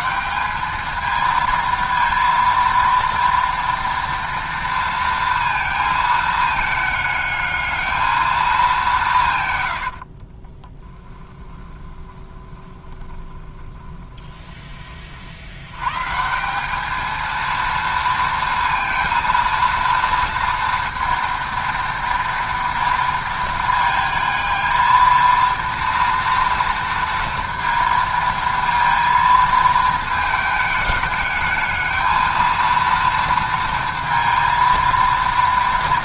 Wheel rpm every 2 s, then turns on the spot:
210, 230, 230, 210, 200, 20, 20, 30, 200, 230, 230, 230, 220, 230, 230, 210, 230, 230.
10-14